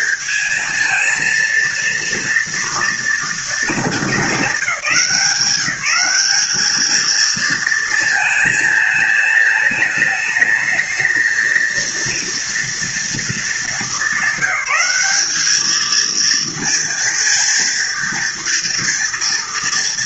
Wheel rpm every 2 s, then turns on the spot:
220, 230, 190, 200, 220, 220, 230, 200, 230, 230.
none